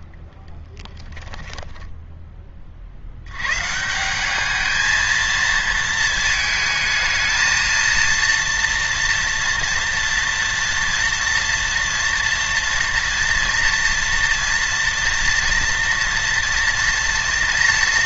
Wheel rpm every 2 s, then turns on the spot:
20, 30, 220, 220, 230, 230, 230, 240, 230.
0-2